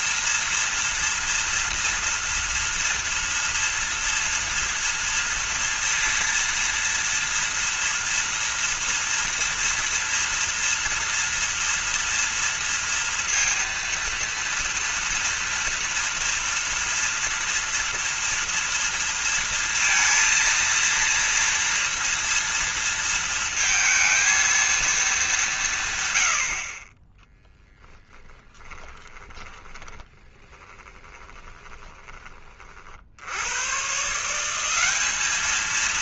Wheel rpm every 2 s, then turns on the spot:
230, 230, 230, 230, 230, 230, 230, 230, 230, 230, 230, 230, 220, 30, 20, 20, 40, 190.
28-32